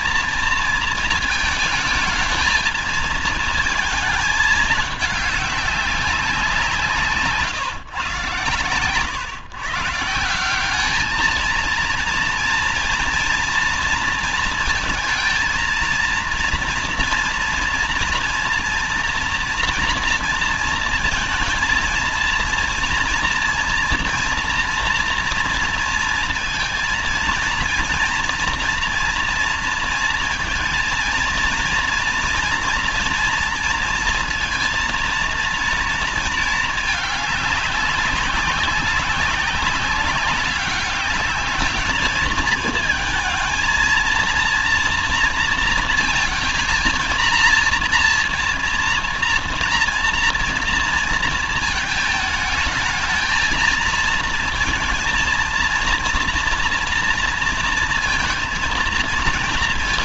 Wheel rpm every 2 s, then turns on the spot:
230, 220, 220, 170, 110, 180, 230, 230, 230, 230, 230, 230, 230, 230, 230, 230, 230, 230, 220, 190, 200, 210, 230, 230, 230, 230, 220, 230, 230, 230.
none